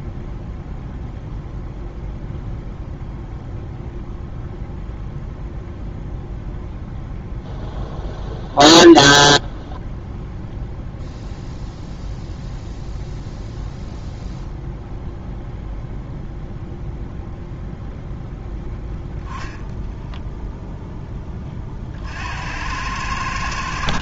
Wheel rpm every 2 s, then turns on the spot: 0, 0, 0, 0, 0, 0, 0, 0, 0, 0, 10, 90.
none